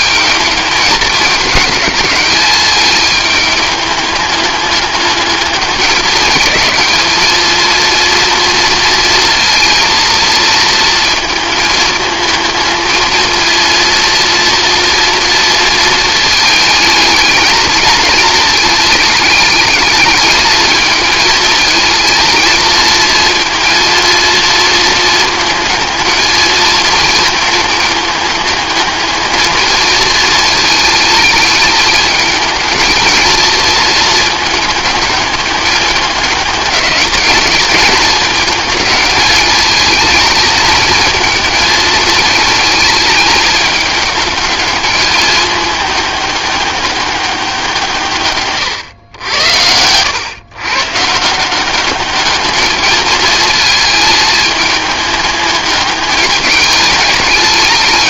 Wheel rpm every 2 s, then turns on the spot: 220, 210, 210, 220, 230, 230, 220, 230, 220, 210, 220, 220, 230, 230, 220, 220, 230, 220, 210, 210, 220, 220, 210, 200, 110, 140, 220, 210, 210.
none